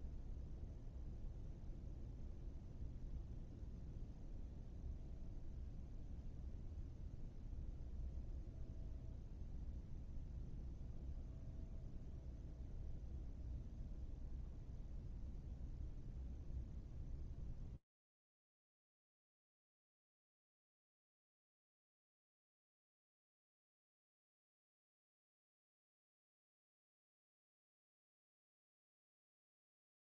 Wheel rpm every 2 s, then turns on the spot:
0, 0, 0, 0, 0, 0, 0, 0, 0, 0, 0, 0, 0, 0, 0.
none